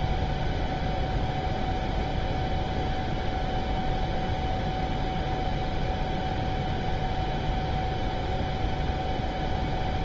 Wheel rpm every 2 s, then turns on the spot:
0, 0, 0, 0, 0.
none